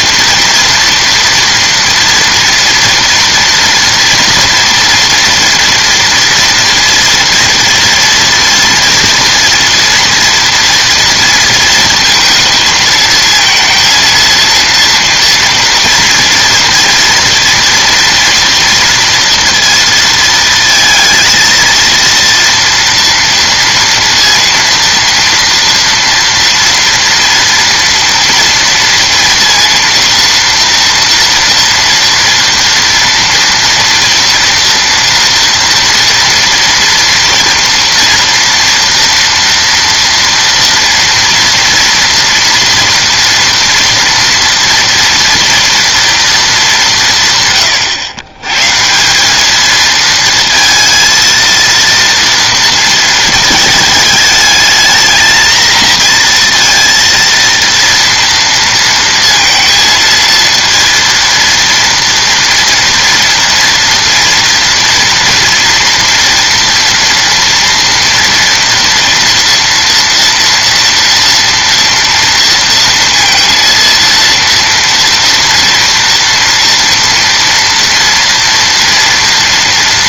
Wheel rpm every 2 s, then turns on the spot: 230, 230, 230, 230, 240, 230, 220, 230, 230, 230, 230, 230, 230, 230, 230, 230, 230, 230, 230, 230, 230, 230, 230, 200, 150, 230, 230, 220, 230, 230, 230, 240, 230, 230, 230, 230, 230, 230, 230, 230.
none